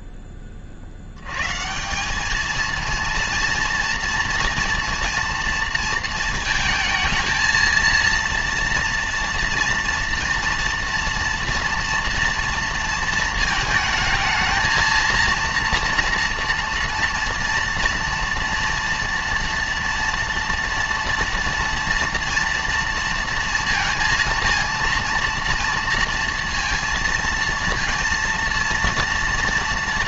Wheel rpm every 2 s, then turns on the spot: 100, 230, 230, 220, 230, 240, 230, 230, 230, 230, 230, 230, 230, 230, 230.
none